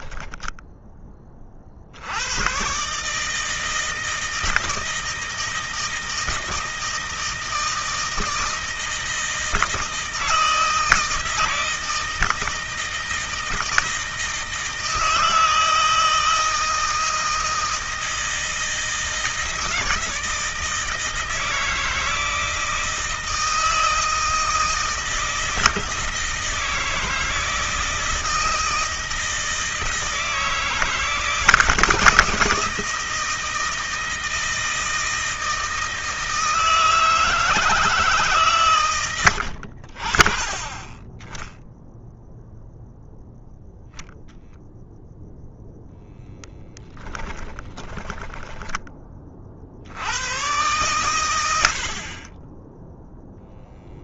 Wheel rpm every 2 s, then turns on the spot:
10, 130, 160, 160, 160, 160, 160, 160, 160, 160, 160, 160, 160, 160, 160, 160, 160, 160, 160, 130, 20, 0, 0, 10, 20, 110, 10.
46-48